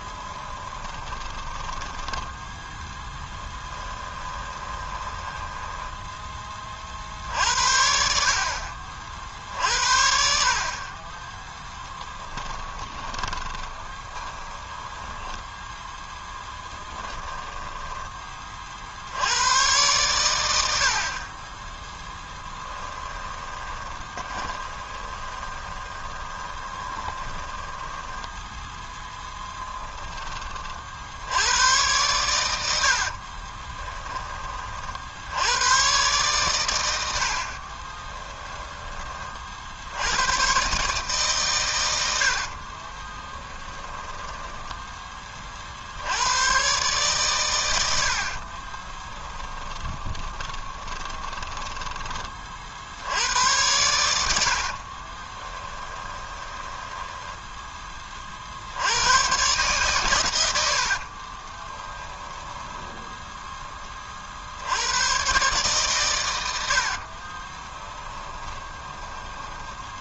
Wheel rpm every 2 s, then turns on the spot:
20, 10, 20, 40, 50, 40, 20, 10, 10, 50, 70, 20, 20, 30, 0, 40, 80, 40, 100, 20, 140, 40, 10, 130, 30, 20, 60, 50, 10, 80, 70, 10, 90, 70, 10.
0-2 4-6 12-18 22-28 42-44 48-52 54-58 60-64 66-70